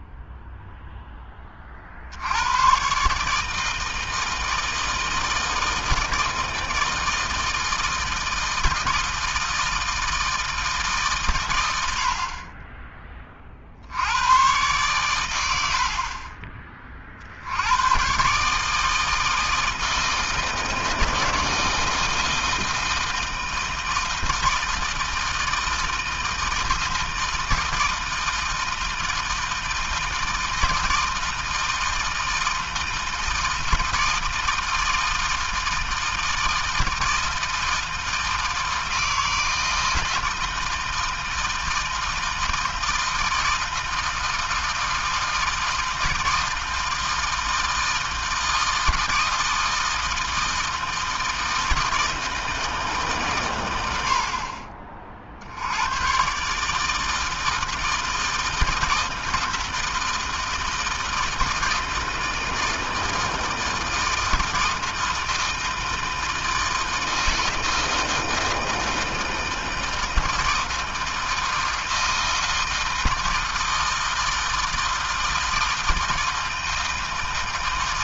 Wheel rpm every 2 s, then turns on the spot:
10, 140, 160, 160, 160, 140, 20, 110, 50, 160, 160, 160, 160, 160, 160, 160, 160, 160, 160, 160, 160, 160, 160, 160, 160, 160, 140, 50, 160, 160, 160, 160, 160, 160, 160, 160, 160, 160, 160.
none